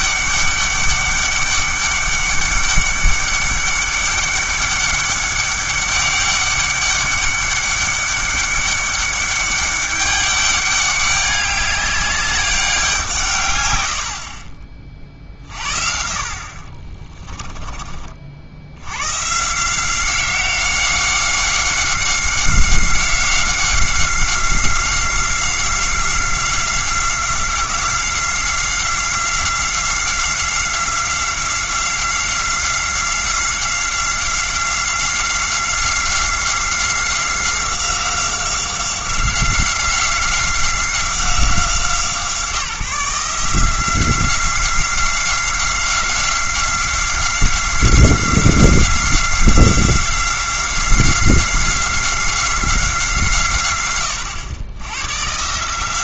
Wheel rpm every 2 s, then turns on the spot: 200, 200, 200, 200, 200, 200, 190, 40, 40, 80, 190, 190, 180, 190, 180, 180, 180, 180, 180, 180, 180, 170, 180, 180, 180, 180, 180, 100.
16-18